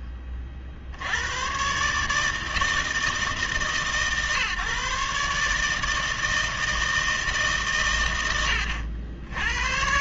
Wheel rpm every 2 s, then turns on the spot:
40, 160, 140, 160, 110.
none